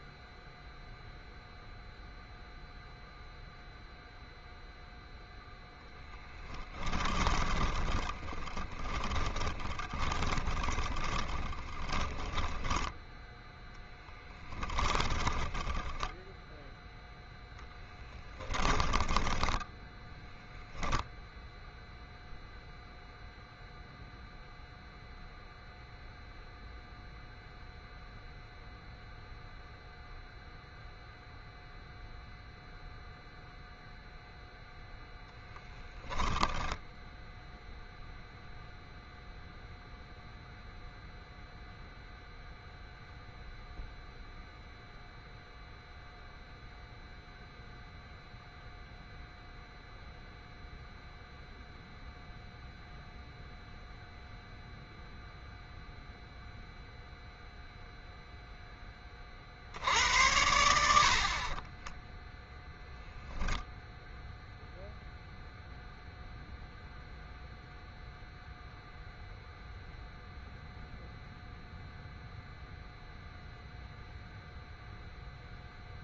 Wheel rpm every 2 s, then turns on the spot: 0, 0, 0, 10, 20, 20, 10, 20, 0, 20, 0, 0, 0, 0, 0, 0, 0, 0, 0, 0, 0, 0, 0, 0, 0, 0, 0, 0, 0, 0, 90, 10, 0, 0, 0, 0, 0, 0.
6-16 18-20 62-64